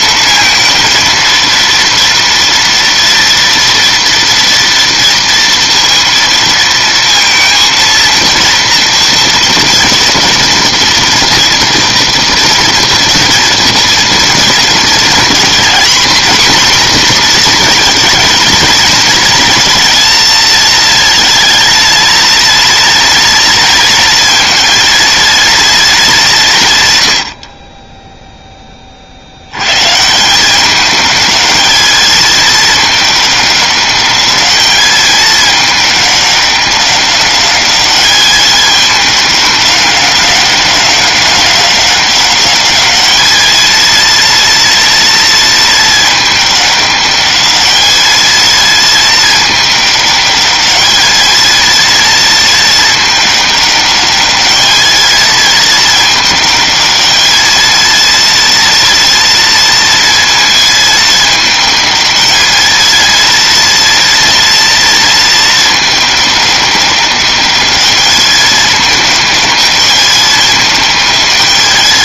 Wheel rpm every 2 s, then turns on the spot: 230, 230, 230, 230, 240, 240, 230, 220, 240, 220, 220, 230, 230, 130, 20, 200, 210, 210, 200, 210, 200, 200, 230, 210, 220, 210, 220, 220, 210, 230, 220, 220, 230, 200, 210, 220.
none